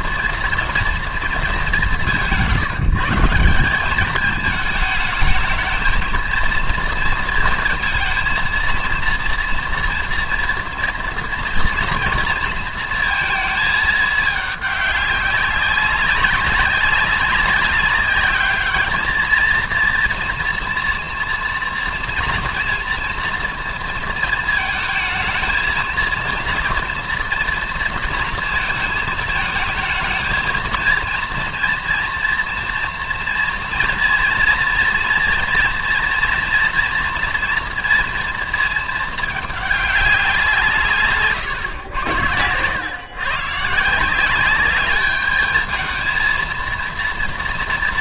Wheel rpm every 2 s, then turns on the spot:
230, 180, 200, 220, 230, 230, 230, 210, 190, 200, 230, 230, 230, 230, 230, 220, 230, 230, 230, 230, 170, 110, 200, 230.
none